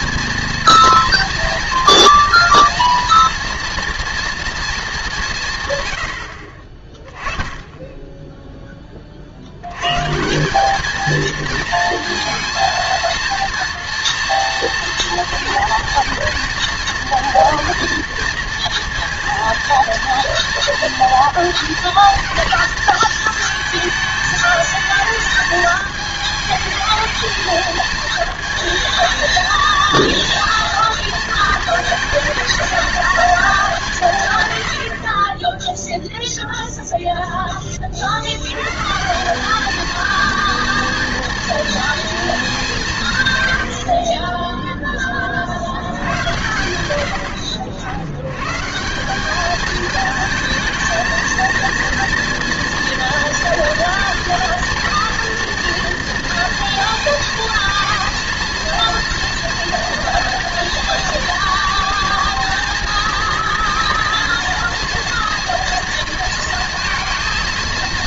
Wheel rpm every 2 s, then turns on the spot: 230, 230, 230, 40, 10, 180, 230, 240, 230, 230, 230, 230, 220, 220, 230, 230, 220, 110, 0, 110, 230, 200, 10, 100, 130, 220, 230, 230, 230, 230, 230, 230, 230, 230.
none